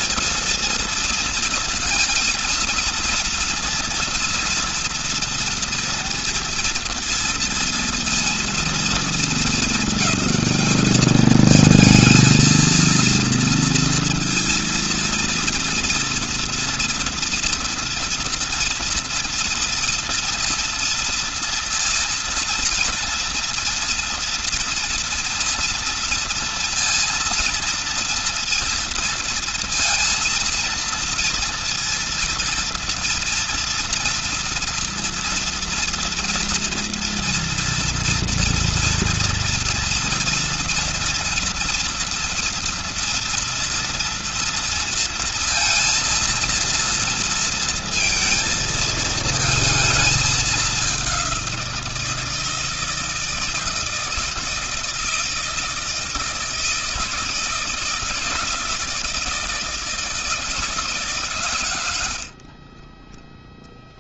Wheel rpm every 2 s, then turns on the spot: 220, 230, 230, 230, 230, 210, 230, 230, 230, 230, 230, 230, 230, 230, 230, 230, 230, 230, 230, 230, 230, 230, 230, 230, 230, 210, 160, 160, 160, 160, 160, 50.
none